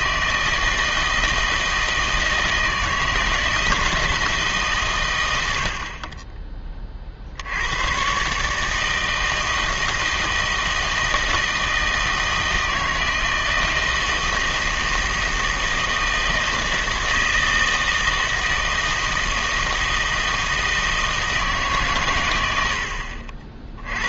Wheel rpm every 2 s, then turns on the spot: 160, 160, 140, 30, 150, 160, 160, 160, 160, 160, 160, 80.
none